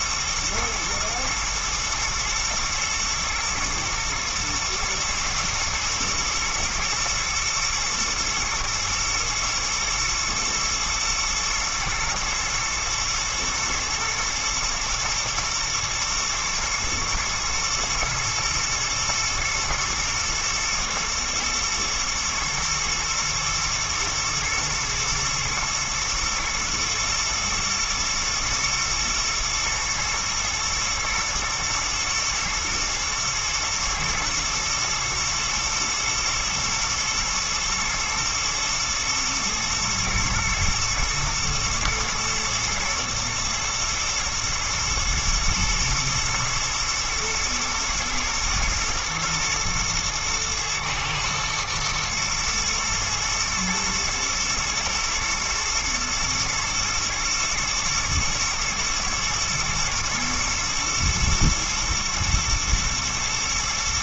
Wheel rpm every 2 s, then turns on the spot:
120, 110, 120, 110, 120, 120, 120, 110, 120, 120, 110, 120, 120, 120, 110, 110, 110, 120, 120, 110, 110, 110, 110, 110, 120, 110, 110, 120, 110, 120, 110, 110.
none